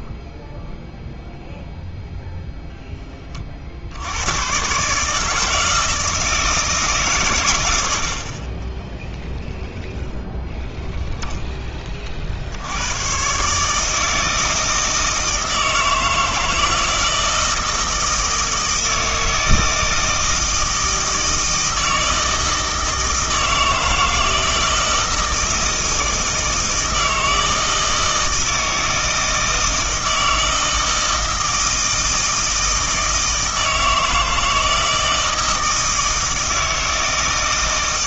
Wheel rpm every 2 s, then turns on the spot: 0, 0, 130, 160, 20, 0, 70, 160, 160, 160, 160, 160, 160, 160, 160, 160, 160, 160, 160.
none